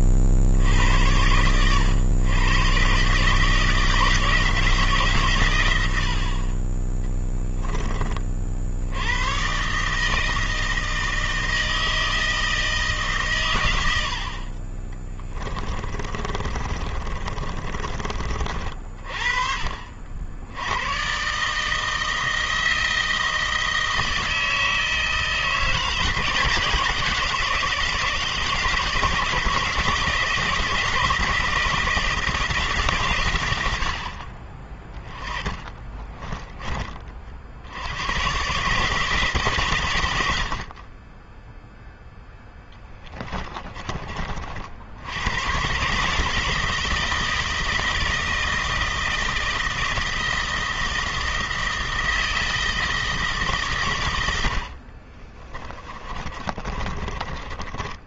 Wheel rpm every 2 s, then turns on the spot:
60, 120, 160, 40, 50, 160, 160, 40, 30, 40, 90, 160, 160, 170, 160, 170, 150, 40, 20, 110, 60, 10, 60, 160, 160, 160, 160, 80, 30.
14-18 36-38 56-58